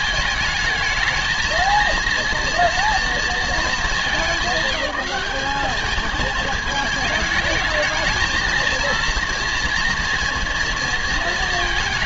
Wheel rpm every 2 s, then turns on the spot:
220, 230, 200, 220, 230, 230.
none